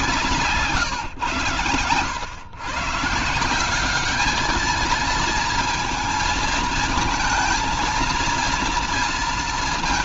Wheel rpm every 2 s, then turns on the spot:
150, 130, 220, 220, 230.
none